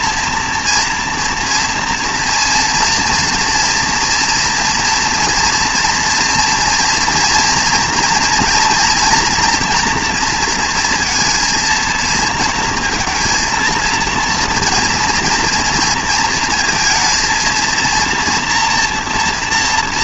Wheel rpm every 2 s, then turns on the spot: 230, 230, 230, 230, 230, 230, 230, 230, 230, 230.
none